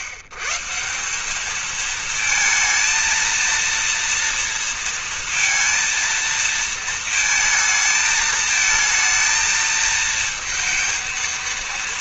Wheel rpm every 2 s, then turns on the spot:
140, 220, 230, 230, 220, 230.
none